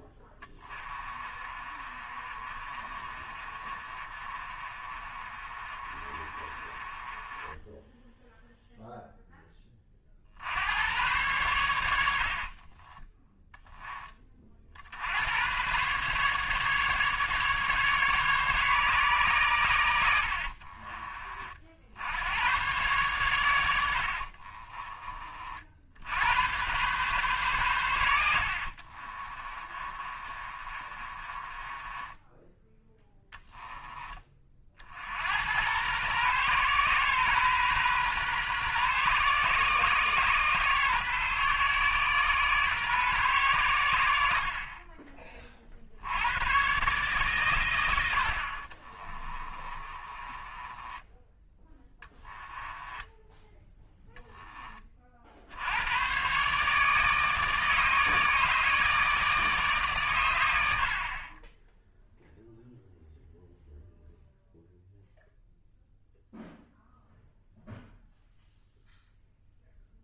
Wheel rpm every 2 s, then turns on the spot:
20, 30, 30, 30, 0, 90, 30, 60, 140, 140, 40, 120, 40, 120, 50, 30, 10, 50, 120, 120, 120, 120, 40, 130, 40, 20, 10, 30, 150, 150, 70, 0, 0, 0, 0.
0-8 12-14 20-22 24-26 28-32 48-54